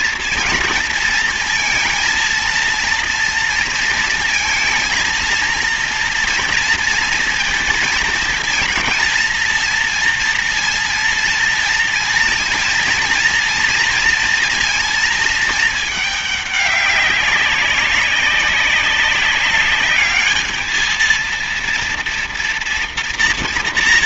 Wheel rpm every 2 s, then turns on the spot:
230, 230, 230, 230, 230, 230, 230, 230, 210, 200, 210, 230.
none